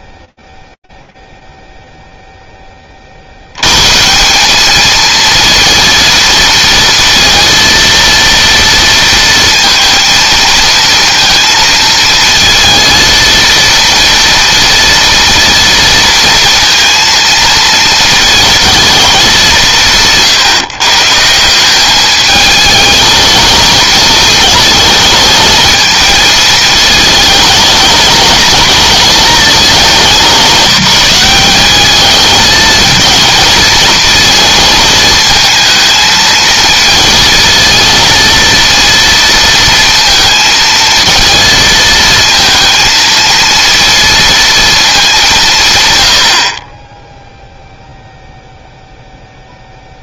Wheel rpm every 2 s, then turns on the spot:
0, 20, 210, 230, 230, 230, 230, 230, 230, 230, 150, 220, 220, 220, 230, 190, 220, 220, 230, 230, 230, 230, 220, 30, 0.
none